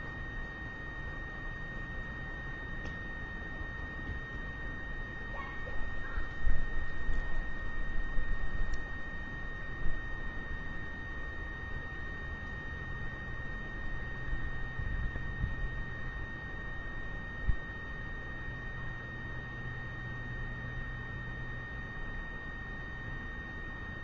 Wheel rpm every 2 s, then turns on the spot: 0, 0, 0, 0, 0, 0, 0, 0, 0, 0, 0, 0.
none